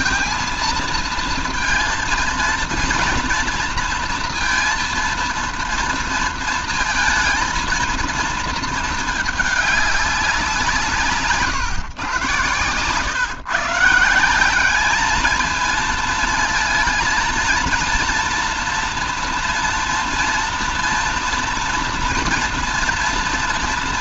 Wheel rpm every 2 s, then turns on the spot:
230, 230, 230, 230, 220, 180, 110, 180, 230, 230, 230, 230.
none